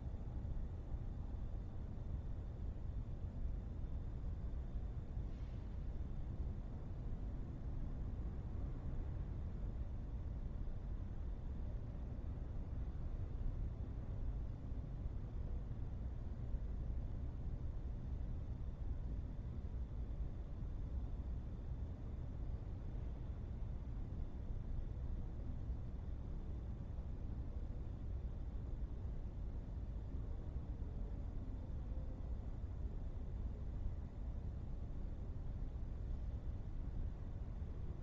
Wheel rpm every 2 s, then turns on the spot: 0, 0, 0, 0, 0, 0, 0, 0, 0, 0, 0, 0, 0, 0, 0, 0, 0, 0, 0.
none